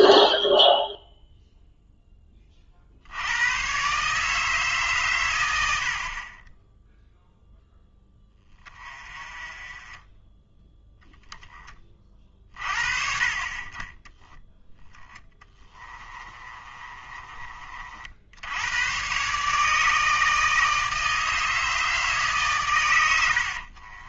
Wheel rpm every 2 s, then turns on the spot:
0, 40, 150, 20, 20, 10, 40, 10, 30, 100, 160, 120.
16-18